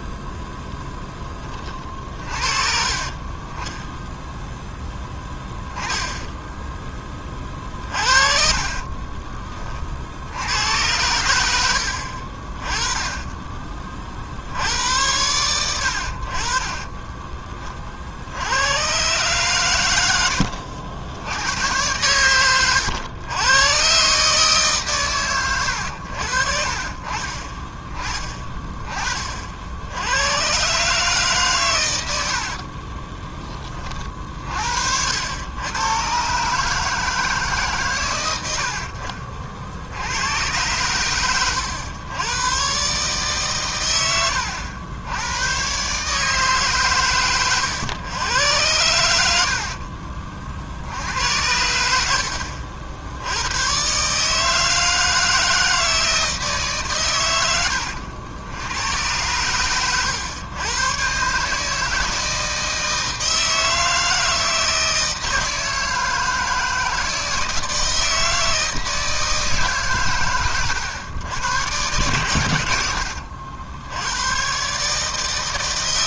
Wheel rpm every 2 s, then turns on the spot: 10, 30, 10, 10, 40, 90, 20, 90, 30, 100, 70, 100, 140, 40, 30, 140, 40, 70, 150, 70, 110, 140, 90, 130, 90, 70, 70, 160, 140, 100, 120, 160, 160, 160, 160, 100, 90, 150.
8-10 32-34